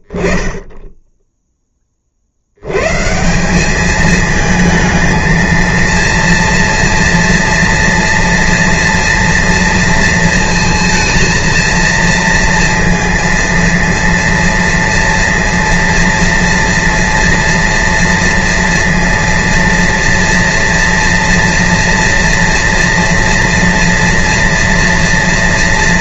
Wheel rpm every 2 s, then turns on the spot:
40, 50, 210, 230, 230, 230, 230, 230, 230, 230, 230, 230, 230.
none